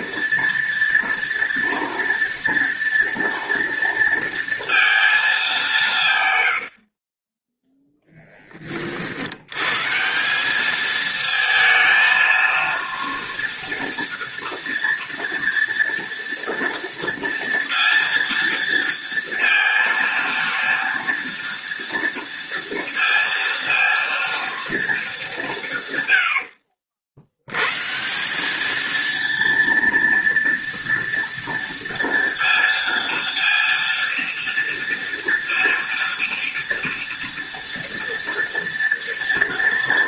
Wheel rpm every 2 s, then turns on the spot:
230, 230, 230, 70, 40, 210, 230, 230, 230, 230, 230, 230, 220, 60, 210, 230, 230, 230, 230, 230.
none